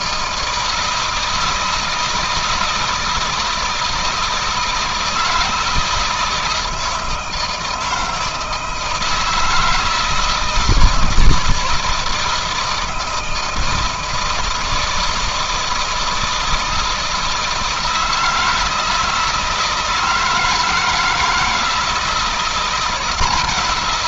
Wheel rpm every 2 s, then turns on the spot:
160, 160, 160, 160, 160, 160, 160, 160, 160, 160, 160, 170.
none